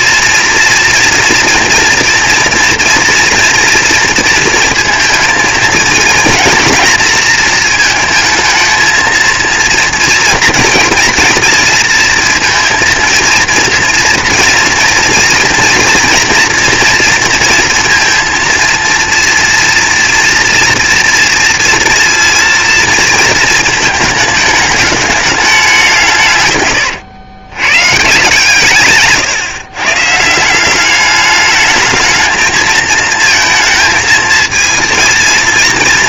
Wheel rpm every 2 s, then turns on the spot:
230, 230, 230, 230, 230, 230, 230, 230, 240, 230, 230, 230, 220, 130, 140, 180, 230, 230.
none